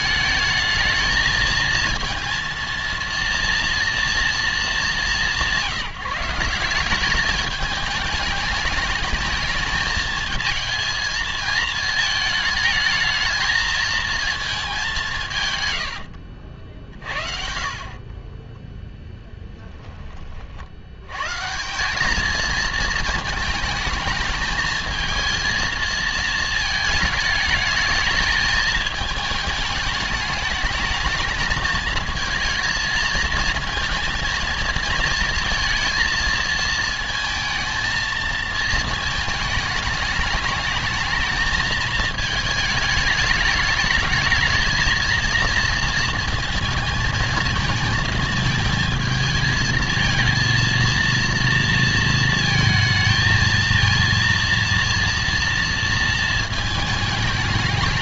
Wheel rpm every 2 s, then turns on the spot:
220, 230, 210, 180, 220, 220, 220, 220, 60, 20, 50, 230, 220, 220, 220, 210, 220, 230, 230, 230, 210, 210, 220, 220, 220, 230, 230, 230, 220.
18-20